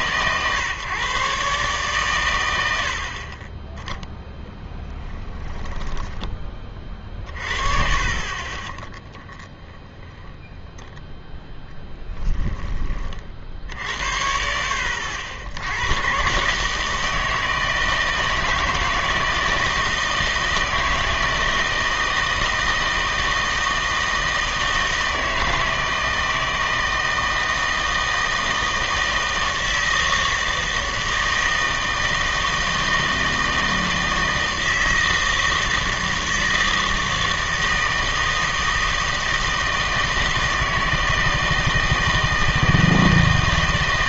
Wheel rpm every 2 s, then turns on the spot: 140, 80, 10, 30, 20, 0, 20, 70, 150, 160, 160, 160, 160, 160, 160, 160, 160, 160, 160, 160, 160, 160.
4-6 8-10